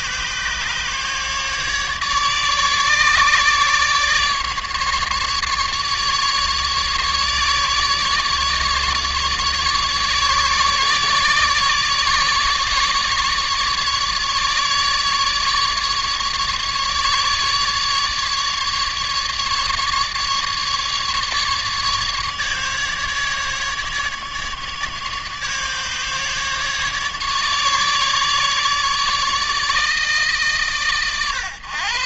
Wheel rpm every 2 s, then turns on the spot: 150, 150, 150, 150, 150, 150, 150, 150, 150, 150, 150, 150, 150, 150, 150, 130.
none